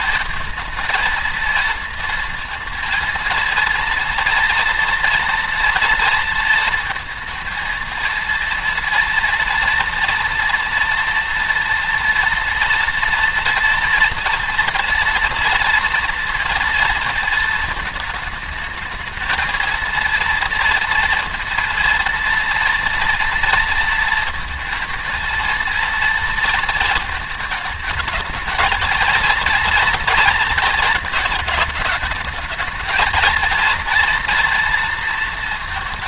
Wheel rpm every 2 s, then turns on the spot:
220, 230, 240, 230, 230, 230, 240, 230, 230, 220, 230, 230, 230, 230, 230, 230, 220, 230.
none